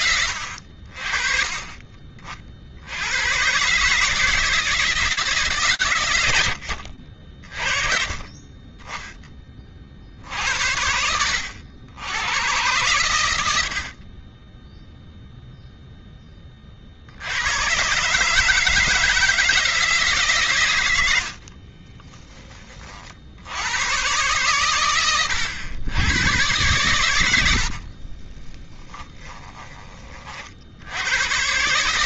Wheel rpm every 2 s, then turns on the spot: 70, 60, 160, 90, 30, 80, 100, 0, 90, 160, 60, 80, 110, 70, 10, 120.
20-22 26-28